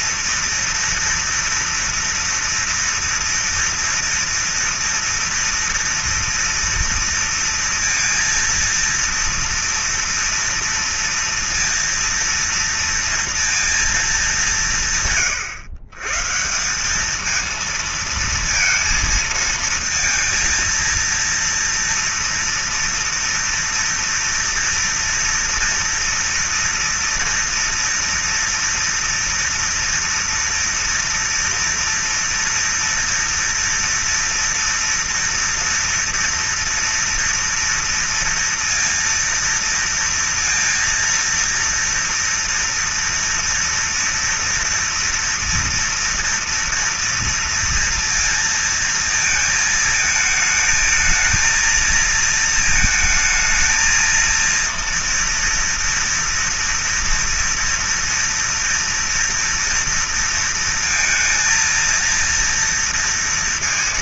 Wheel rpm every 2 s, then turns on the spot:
230, 240, 230, 230, 230, 230, 230, 160, 190, 230, 230, 230, 230, 230, 230, 230, 230, 240, 230, 230, 230, 230, 230, 230, 230, 220, 220, 230, 230, 230, 230, 230.
none